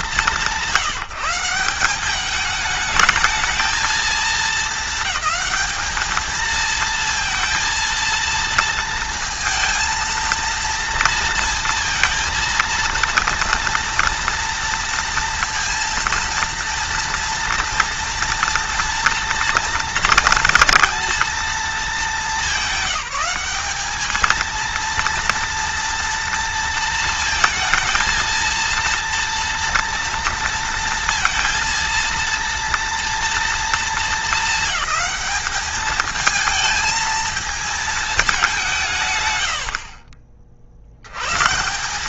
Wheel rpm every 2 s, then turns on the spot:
170, 220, 220, 230, 230, 230, 230, 230, 230, 230, 230, 200, 230, 230, 230, 230, 230, 220, 220, 180, 40.
none